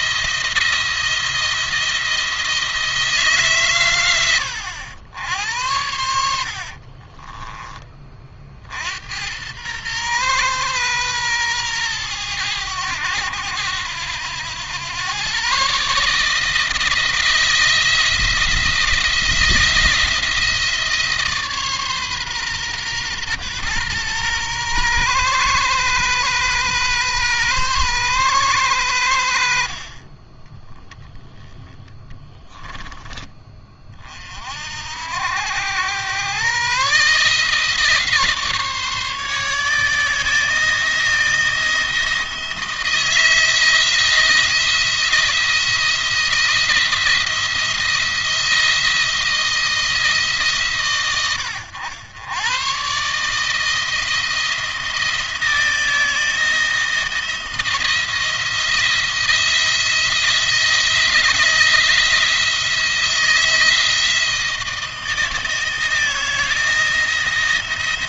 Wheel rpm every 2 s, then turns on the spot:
160, 170, 90, 60, 50, 120, 100, 100, 160, 170, 160, 130, 120, 120, 110, 10, 10, 50, 130, 150, 160, 170, 170, 170, 160, 140, 120, 170, 160, 170, 170, 170, 160, 170.
6-8 32-34